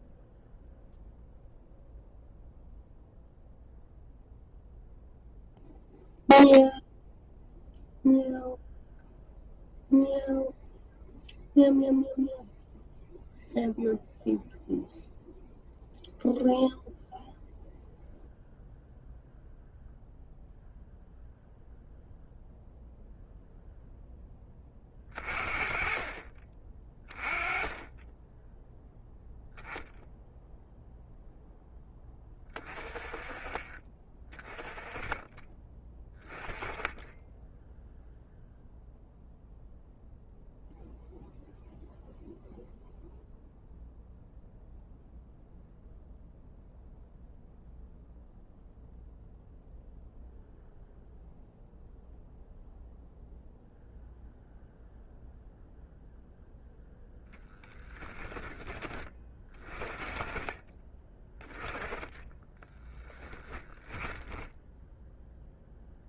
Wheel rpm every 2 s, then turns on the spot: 0, 0, 0, 0, 0, 0, 0, 0, 0, 0, 0, 0, 30, 20, 0, 0, 30, 20, 10, 0, 0, 0, 0, 0, 0, 0, 0, 0, 10, 30, 20, 10, 0.
62-64